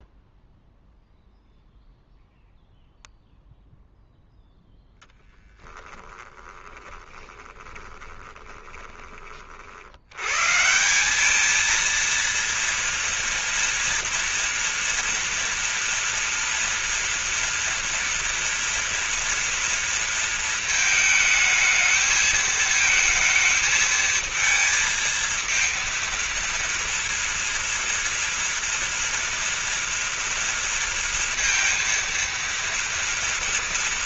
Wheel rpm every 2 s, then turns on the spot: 0, 0, 0, 20, 20, 160, 230, 240, 230, 230, 220, 220, 220, 230, 230, 230, 230.
6-10